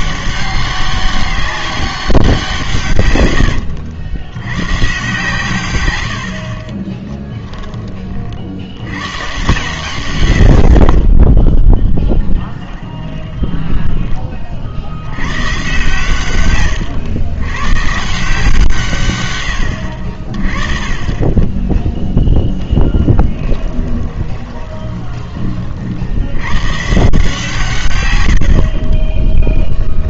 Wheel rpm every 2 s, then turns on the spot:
190, 140, 120, 40, 80, 50, 20, 40, 120, 170, 30, 10, 20, 120, 50.
12-14 24-26